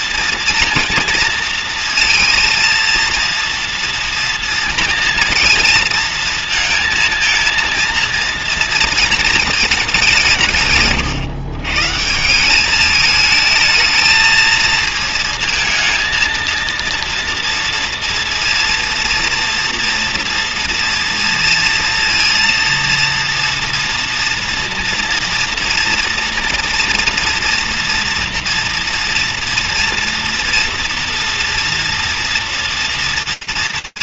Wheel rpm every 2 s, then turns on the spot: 230, 230, 230, 230, 230, 130, 200, 220, 230, 230, 230, 230, 230, 230, 230, 230, 230.
none